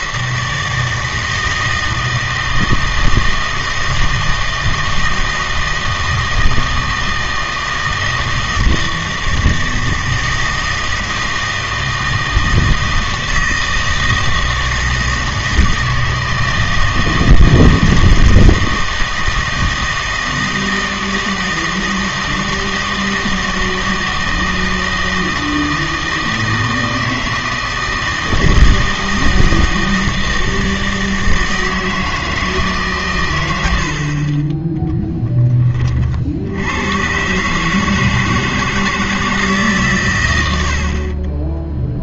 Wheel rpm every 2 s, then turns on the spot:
160, 160, 160, 160, 160, 160, 160, 160, 160, 160, 160, 160, 160, 160, 160, 160, 150, 10, 100, 160, 70.
none